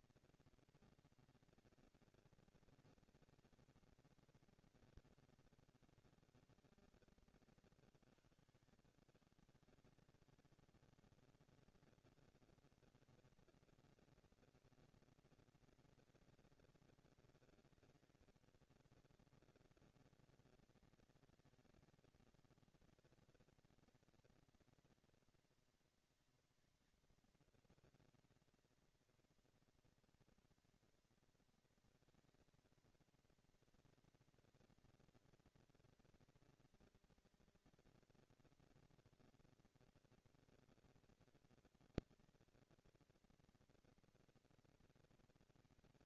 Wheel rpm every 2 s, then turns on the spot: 230, 230, 230, 190, 100, 190, 230, 230, 230, 230, 230, 230, 230, 230, 230, 220, 230, 230, 230, 230, 230, 230, 230.
none